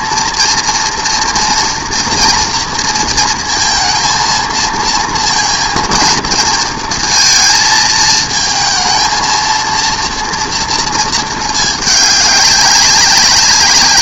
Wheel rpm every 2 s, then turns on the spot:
230, 230, 230, 230, 220, 230, 200.
none